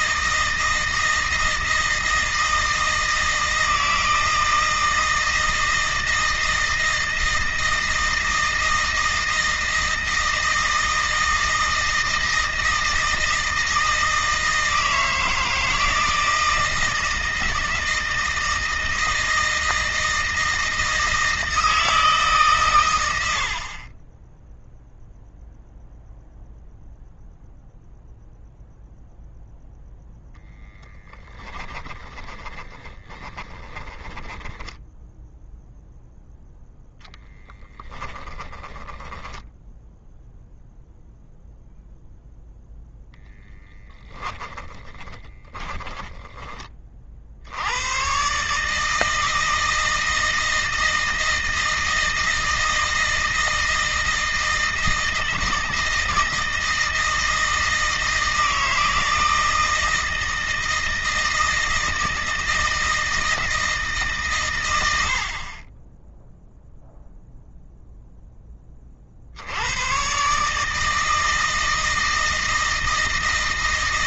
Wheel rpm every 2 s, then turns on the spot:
160, 160, 160, 160, 160, 160, 160, 160, 160, 160, 160, 90, 0, 0, 0, 10, 10, 0, 0, 10, 0, 0, 20, 40, 150, 160, 160, 160, 160, 160, 160, 160, 90, 0, 40, 160, 160.
30-34 38-40 44-46